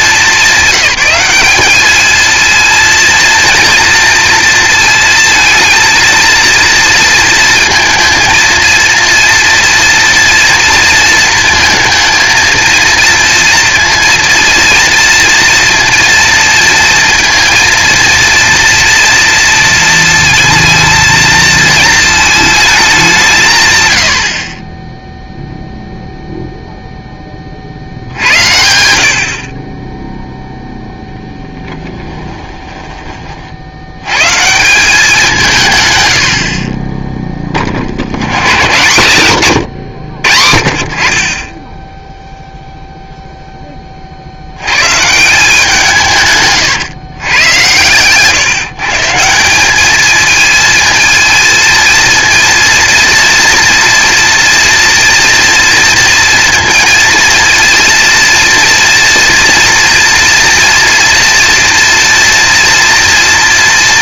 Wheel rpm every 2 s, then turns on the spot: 190, 220, 230, 230, 230, 230, 230, 230, 230, 230, 230, 220, 30, 0, 80, 0, 20, 160, 50, 150, 50, 0, 90, 130, 150, 220, 230, 230, 230, 230, 240, 230.
32-34